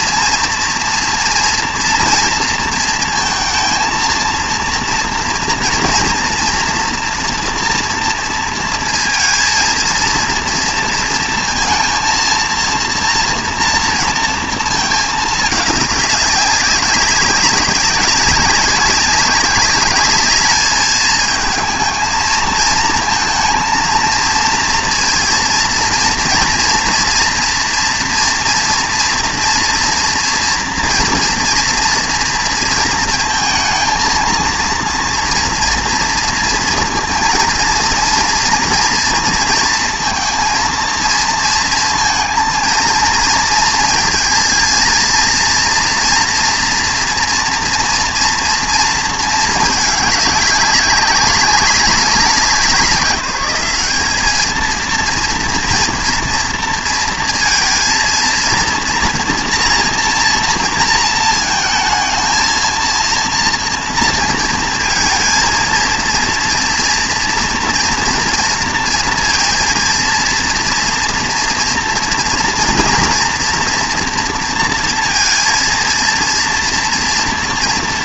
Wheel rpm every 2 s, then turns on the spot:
230, 230, 230, 230, 230, 230, 230, 220, 200, 200, 210, 220, 230, 230, 230, 240, 230, 230, 230, 230, 230, 230, 230, 230, 230, 190, 180, 230, 230, 230, 230, 230, 230, 230, 230, 230, 230, 230, 230.
none